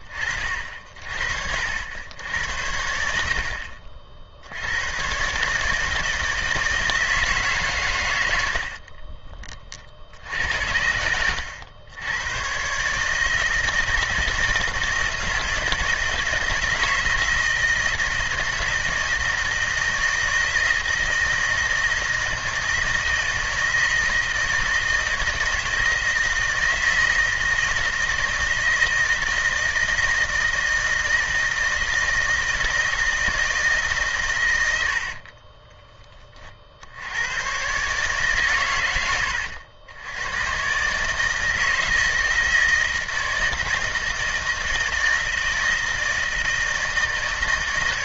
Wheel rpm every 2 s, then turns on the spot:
40, 90, 90, 160, 60, 80, 130, 160, 160, 160, 160, 160, 160, 160, 160, 160, 160, 90, 60, 120, 130, 160, 160, 160.
8-12 34-36